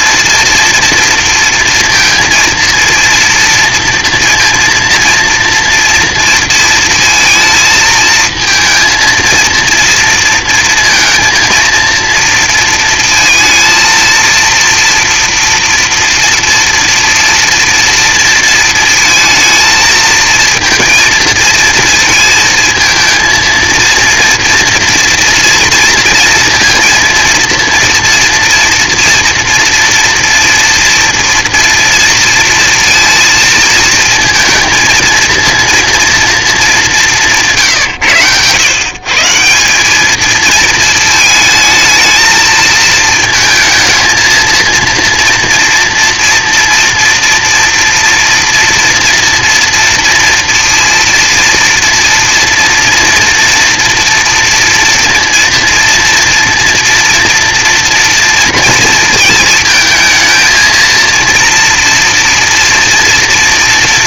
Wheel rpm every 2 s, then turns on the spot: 230, 230, 230, 230, 220, 230, 230, 230, 230, 230, 230, 220, 230, 230, 230, 230, 230, 230, 210, 120, 230, 220, 230, 240, 230, 230, 230, 230, 230, 230, 230, 230.
none